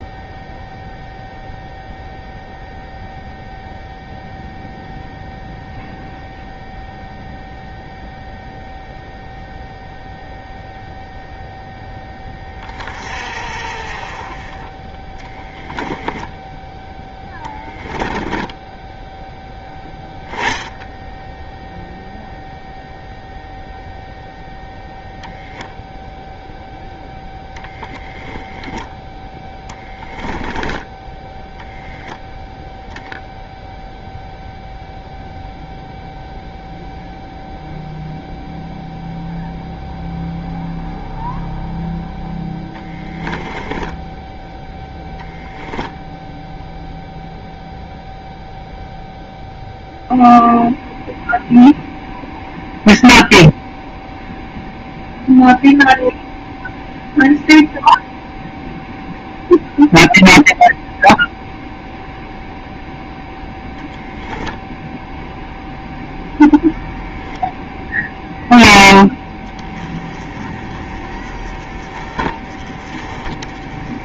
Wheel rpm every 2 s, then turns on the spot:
0, 0, 0, 0, 0, 0, 20, 20, 10, 10, 10, 0, 0, 0, 10, 10, 0, 0, 0, 0, 0, 10, 10, 0, 0, 0, 0, 0, 0, 0, 0, 0, 0, 0, 0, 20, 30.
18-20 42-44